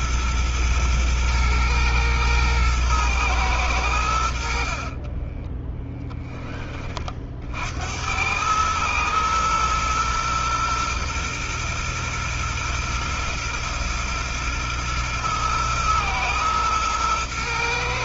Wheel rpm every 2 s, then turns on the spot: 120, 110, 50, 30, 110, 120, 120, 120, 110.
4-6